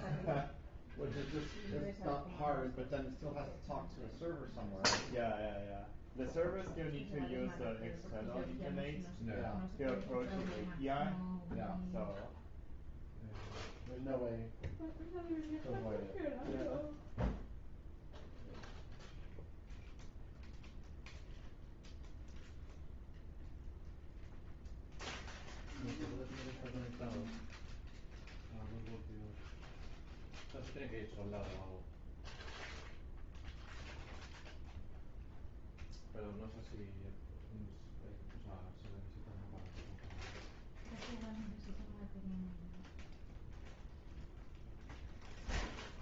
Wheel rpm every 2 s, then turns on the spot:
0, 0, 0, 0, 0, 0, 0, 0, 0, 0, 0, 0, 0, 0, 0, 0, 0, 0, 0, 0, 0, 0, 0.
none